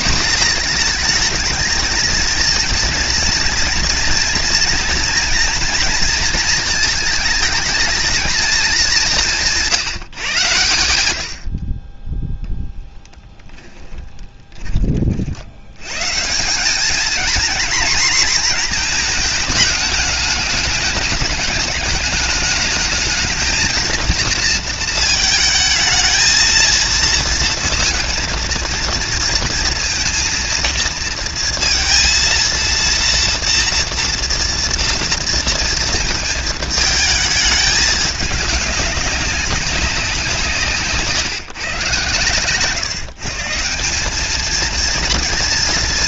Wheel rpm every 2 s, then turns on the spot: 220, 230, 230, 220, 210, 90, 0, 30, 200, 230, 210, 210, 230, 230, 230, 230, 230, 230, 220, 200, 150, 140, 230.
none